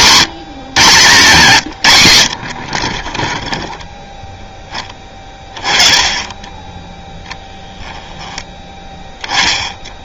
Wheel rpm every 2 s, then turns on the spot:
150, 40, 10, 10, 10.
none